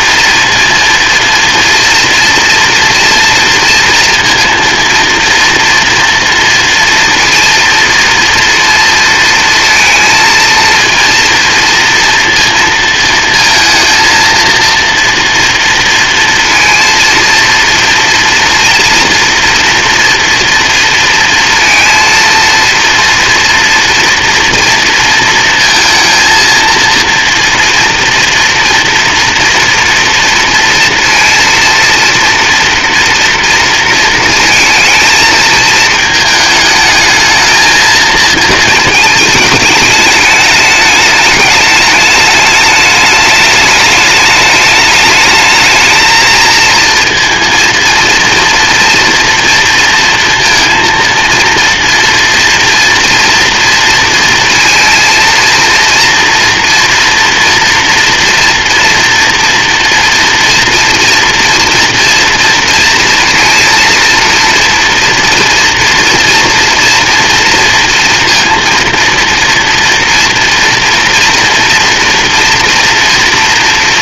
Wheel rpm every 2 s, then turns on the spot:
230, 230, 230, 230, 230, 230, 230, 230, 230, 230, 230, 230, 230, 230, 230, 230, 230, 220, 220, 220, 210, 220, 210, 230, 230, 230, 230, 230, 230, 240, 230, 230, 230, 230, 230, 230, 230.
none